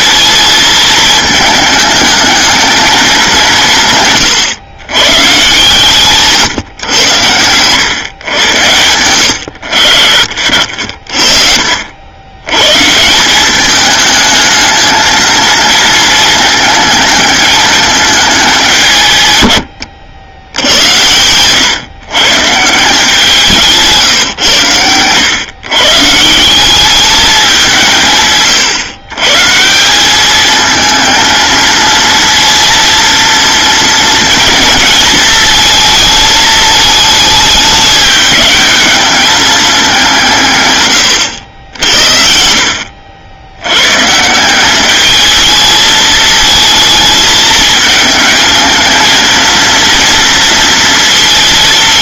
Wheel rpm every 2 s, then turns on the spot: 220, 210, 120, 120, 100, 50, 140, 220, 220, 160, 90, 160, 100, 200, 130, 220, 230, 230, 220, 210, 140, 70, 200, 220, 230, 230.
none